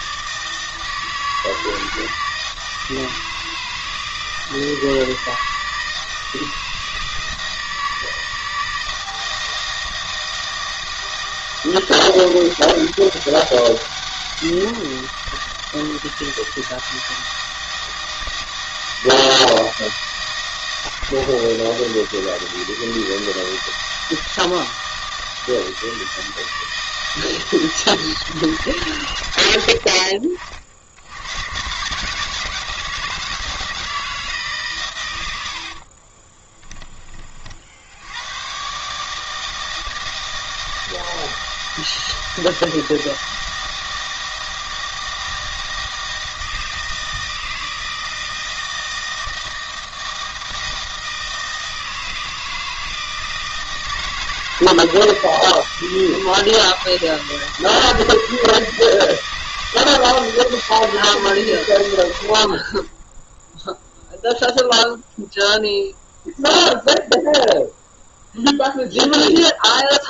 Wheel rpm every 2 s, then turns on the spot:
160, 160, 160, 160, 160, 160, 190, 170, 160, 160, 160, 160, 160, 160, 140, 60, 170, 130, 20, 130, 160, 160, 160, 160, 160, 160, 160, 160, 160, 160, 160, 30, 0, 0, 0.
none